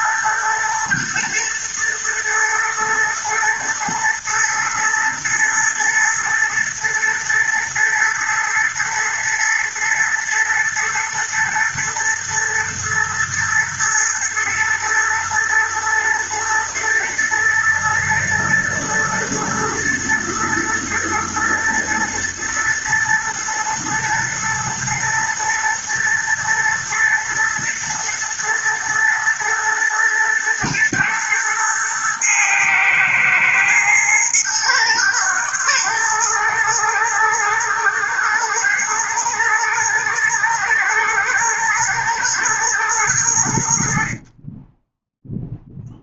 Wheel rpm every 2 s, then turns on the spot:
110, 120, 120, 110, 110, 120, 110, 110, 110, 110, 120, 110, 110, 120, 110, 110, 110, 110, 110, 120, 110, 100, 10.
none